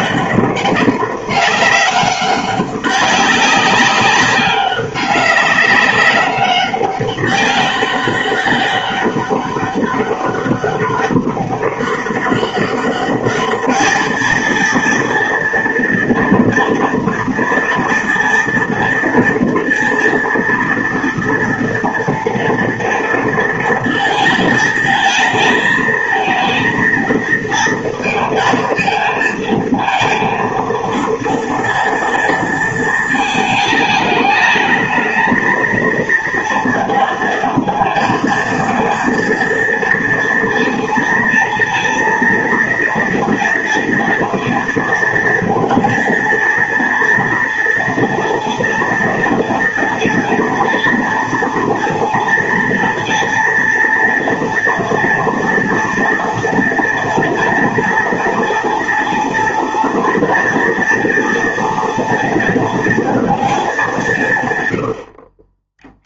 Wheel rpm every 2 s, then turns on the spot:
200, 200, 200, 200, 200, 190, 200, 230, 230, 230, 230, 230, 220, 220, 230, 230, 220, 210, 230, 230, 230, 230, 230, 230, 230, 230, 230, 230, 240, 240, 230, 230, 100.
none